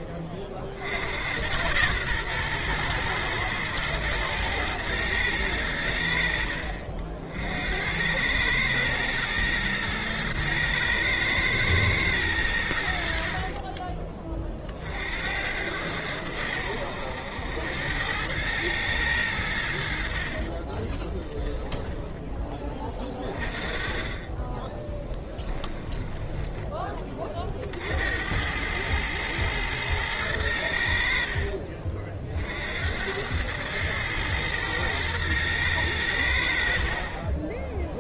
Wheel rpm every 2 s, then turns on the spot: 60, 120, 110, 60, 110, 110, 90, 40, 90, 110, 30, 20, 20, 10, 90, 90, 60, 110, 80.
20-22 26-28